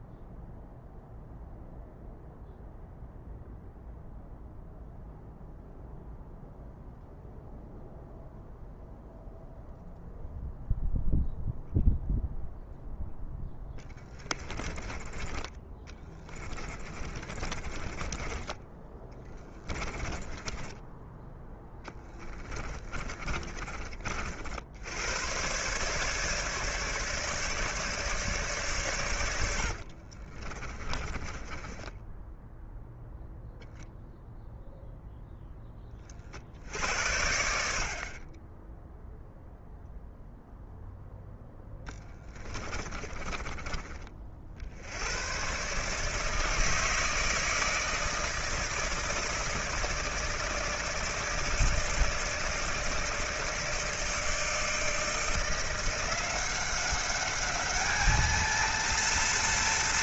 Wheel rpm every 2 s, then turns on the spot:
0, 0, 0, 0, 0, 0, 0, 20, 20, 10, 10, 20, 70, 150, 130, 30, 0, 0, 60, 10, 0, 30, 80, 160, 160, 160, 160, 160, 190, 230.
14-24 30-32 42-44